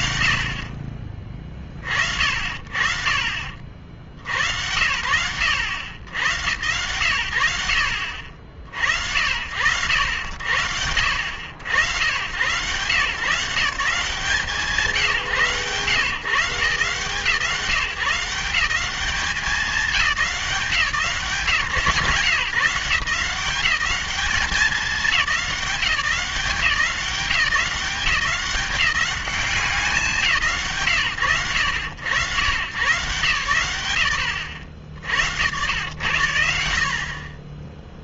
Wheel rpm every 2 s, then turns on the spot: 30, 30, 80, 90, 70, 60, 130, 140, 140, 200, 160, 160, 200, 180, 200, 120, 130, 80, 40.
none